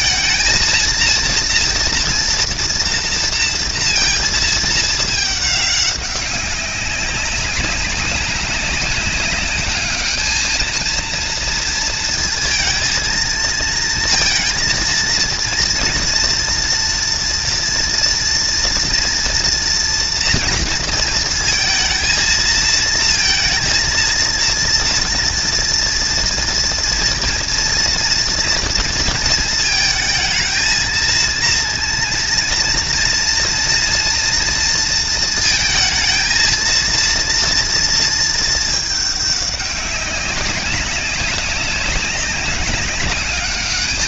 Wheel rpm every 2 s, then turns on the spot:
230, 230, 220, 190, 190, 220, 230, 230, 230, 230, 230, 220, 230, 230, 230, 220, 230, 230, 230, 220, 190, 200.
none